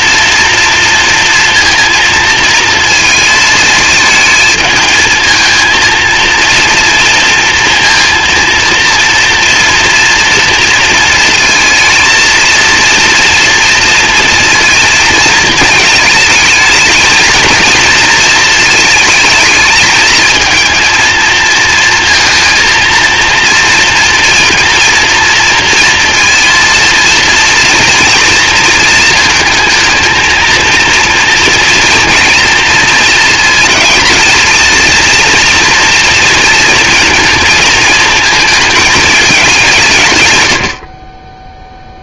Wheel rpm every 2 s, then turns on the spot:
230, 230, 220, 230, 230, 230, 230, 230, 220, 220, 220, 230, 230, 230, 220, 230, 230, 230, 230, 220, 80.
none